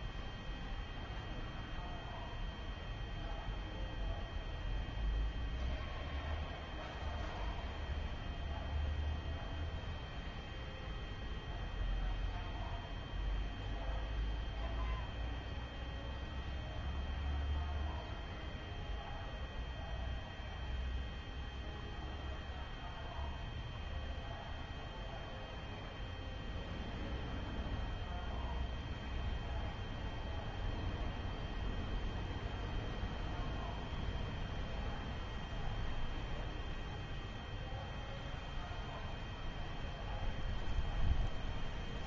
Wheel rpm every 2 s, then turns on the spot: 0, 0, 0, 0, 0, 0, 0, 0, 0, 0, 0, 0, 0, 0, 0, 0, 0, 0, 0, 0, 0.
none